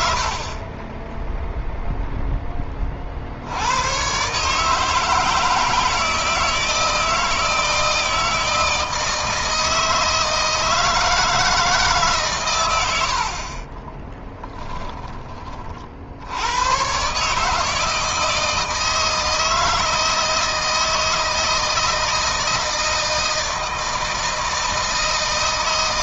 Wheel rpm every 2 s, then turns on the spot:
20, 20, 150, 160, 160, 160, 100, 20, 110, 160, 160, 160, 160.
14-16